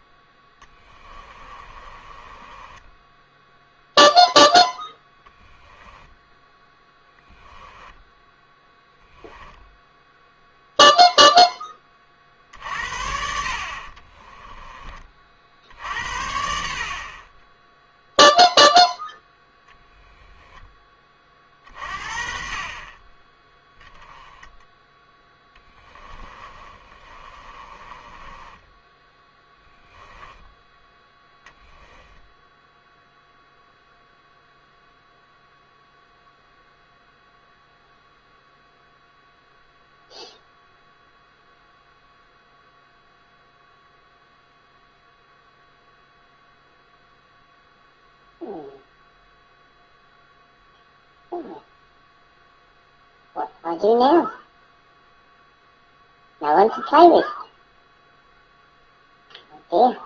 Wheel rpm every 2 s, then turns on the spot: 10, 10, 10, 10, 10, 0, 50, 20, 60, 0, 10, 30, 10, 20, 10, 10, 0, 0, 0, 0, 0, 0, 0, 0, 0, 0, 0, 0, 0, 0.
0-4 6-10 26-30